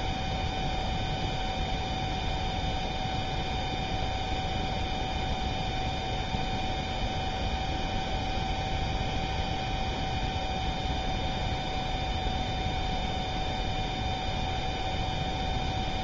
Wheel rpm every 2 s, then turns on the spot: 0, 0, 0, 0, 0, 0, 0, 0.
none